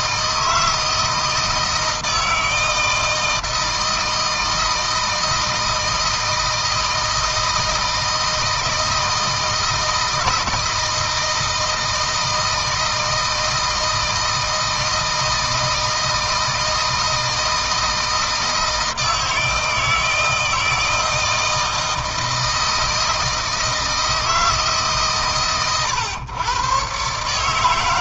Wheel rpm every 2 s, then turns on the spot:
160, 160, 160, 160, 160, 160, 160, 160, 160, 160, 160, 160, 150, 130.
none